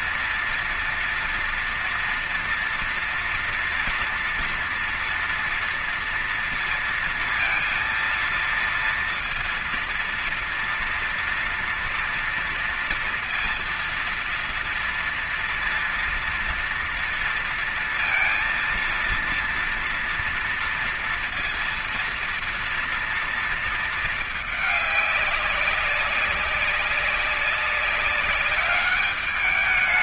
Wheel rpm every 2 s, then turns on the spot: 230, 230, 230, 230, 230, 230, 230, 230, 230, 230, 230, 240, 220, 200, 200.
none